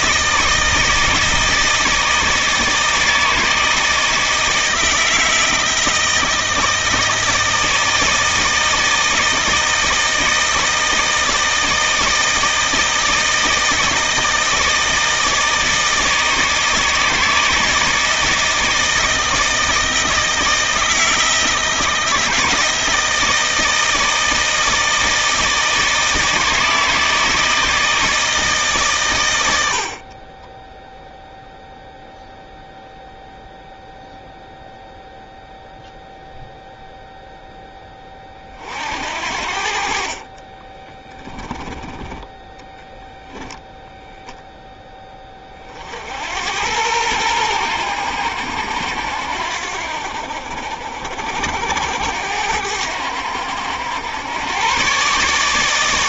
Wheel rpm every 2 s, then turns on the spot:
160, 160, 160, 160, 160, 160, 160, 160, 160, 160, 160, 160, 160, 160, 140, 10, 0, 0, 0, 50, 10, 0, 10, 100, 80, 60, 90, 130.
30-32 40-42